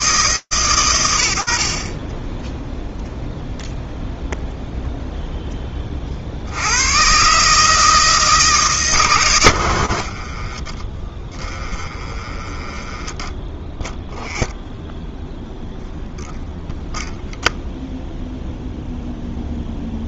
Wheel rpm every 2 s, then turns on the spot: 50, 0, 10, 150, 50, 10, 0, 0, 0, 0.
8-10